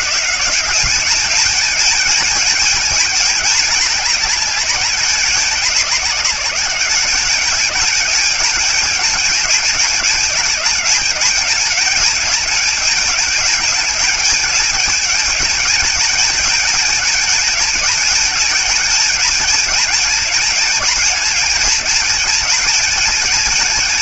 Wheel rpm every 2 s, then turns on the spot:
200, 210, 200, 200, 210, 210, 210, 210, 210, 220, 220, 210.
none